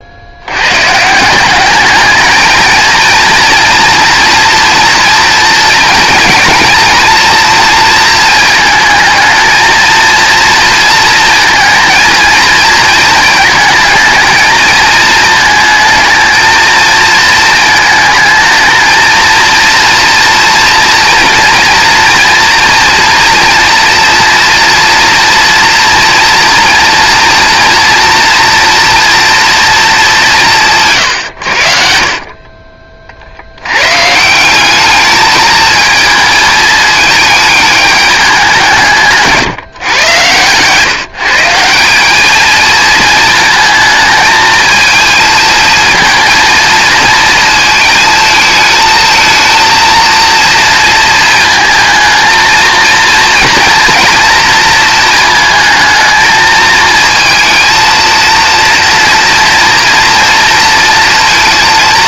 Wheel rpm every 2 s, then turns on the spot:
150, 230, 230, 240, 220, 230, 220, 220, 230, 230, 230, 240, 230, 230, 230, 130, 40, 210, 210, 150, 150, 220, 220, 220, 220, 230, 230, 220, 220, 230, 230.
30-32